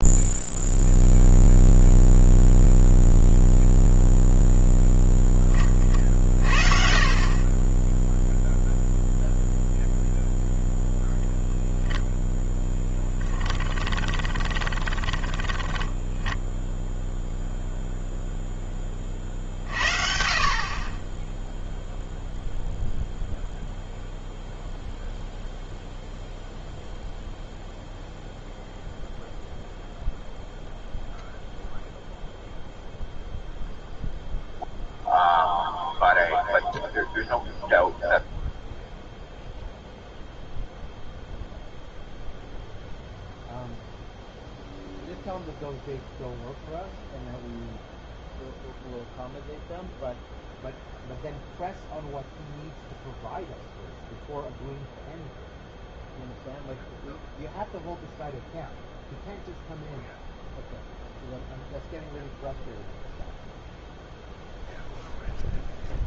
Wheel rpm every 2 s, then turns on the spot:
0, 0, 0, 40, 0, 0, 10, 20, 0, 10, 30, 0, 0, 0, 0, 0, 0, 0, 0, 0, 0, 0, 0, 0, 0, 0, 0, 0, 0, 0, 0, 0, 0.
14-16